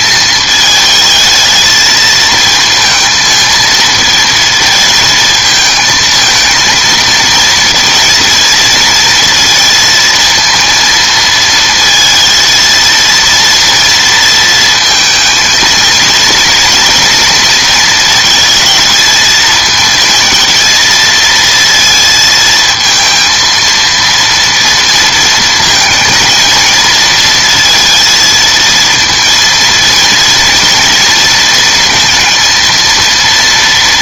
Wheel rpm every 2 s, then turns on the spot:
220, 230, 230, 220, 230, 230, 230, 230, 230, 220, 230, 220, 230, 230, 230, 230, 230.
none